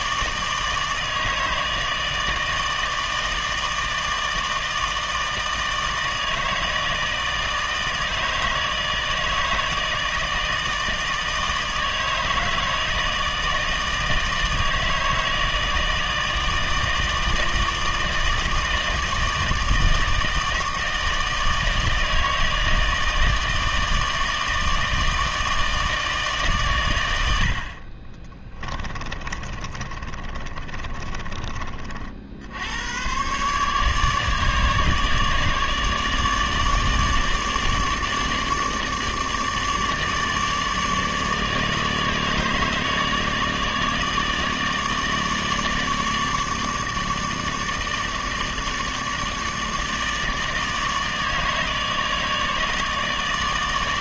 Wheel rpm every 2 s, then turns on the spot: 160, 160, 160, 160, 160, 160, 160, 160, 160, 160, 160, 160, 160, 80, 30, 20, 110, 150, 150, 150, 150, 150, 160, 160, 150, 150, 150.
28-32